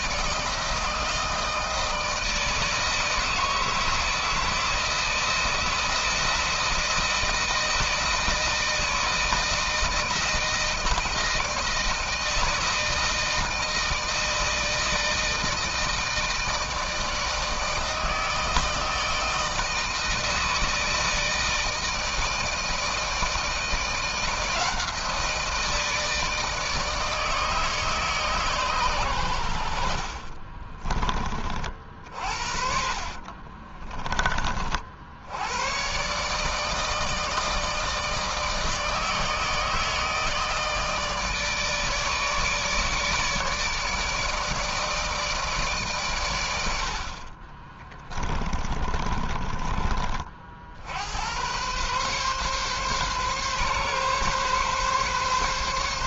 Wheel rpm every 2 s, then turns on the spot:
160, 160, 160, 160, 160, 160, 160, 160, 160, 160, 160, 160, 170, 150, 120, 30, 60, 60, 160, 160, 150, 150, 160, 60, 30, 70, 140, 140.
32-34 48-50